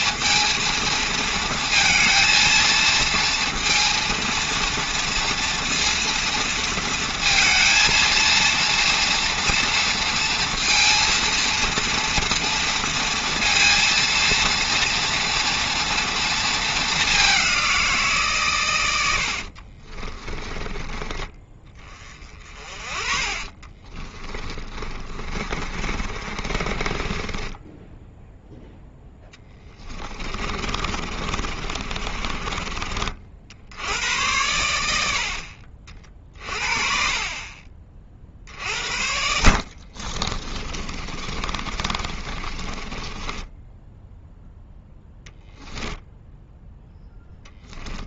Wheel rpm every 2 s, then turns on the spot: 230, 230, 230, 230, 230, 230, 230, 230, 210, 100, 20, 40, 50, 30, 0, 40, 60, 70, 40, 60, 30, 20, 10, 0.
22-28 30-32 34-36 38-44